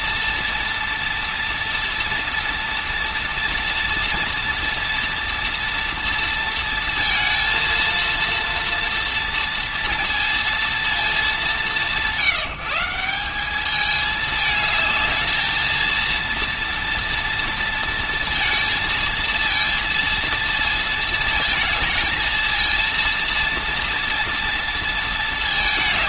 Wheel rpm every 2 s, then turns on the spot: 230, 240, 230, 230, 230, 230, 160, 220, 230, 230, 230, 230, 230.
none